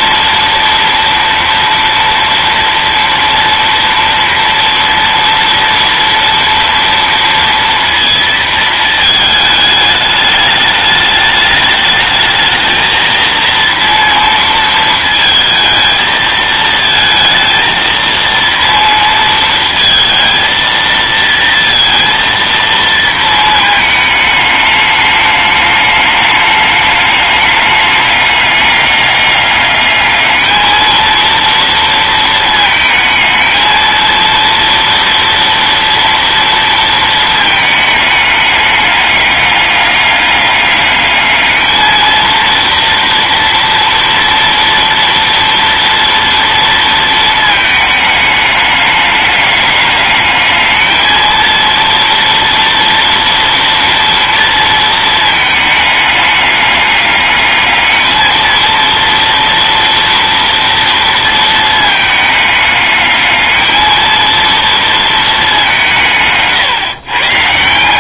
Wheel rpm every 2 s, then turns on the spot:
230, 230, 230, 230, 220, 210, 220, 230, 220, 230, 230, 230, 210, 210, 200, 220, 220, 230, 230, 210, 200, 230, 230, 230, 210, 220, 230, 230, 210, 220, 230, 210, 230, 140.
66-68